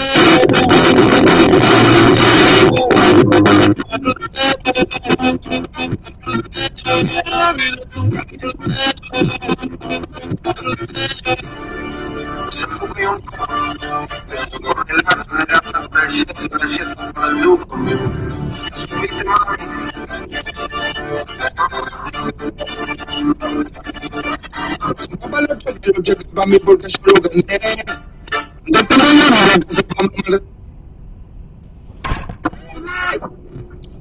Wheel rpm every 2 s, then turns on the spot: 0, 0, 0, 0, 0, 0, 0, 0, 0, 0, 0, 0, 0, 0, 0, 0, 0.
none